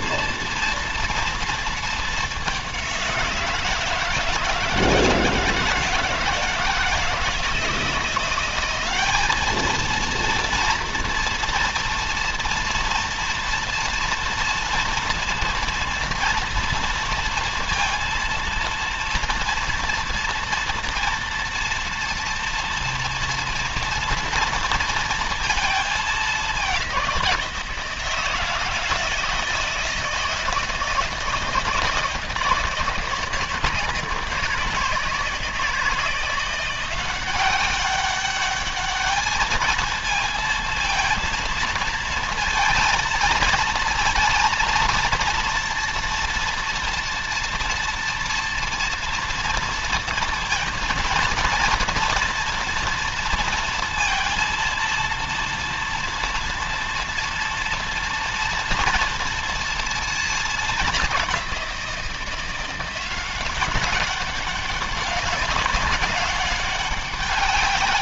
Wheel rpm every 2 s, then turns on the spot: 230, 190, 160, 160, 190, 240, 230, 230, 230, 230, 230, 230, 230, 190, 160, 160, 160, 160, 180, 210, 230, 230, 230, 230, 230, 230, 230, 230, 230, 230, 220, 180, 200, 200.
none